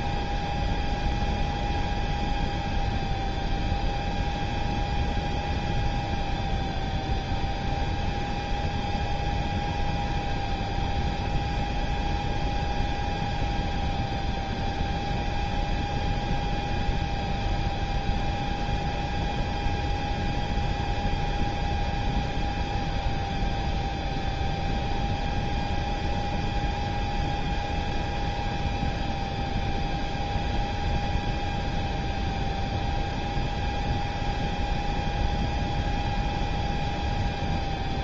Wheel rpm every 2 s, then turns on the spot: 0, 0, 0, 0, 0, 0, 0, 0, 0, 0, 0, 0, 0, 0, 0, 0, 0, 0, 0.
none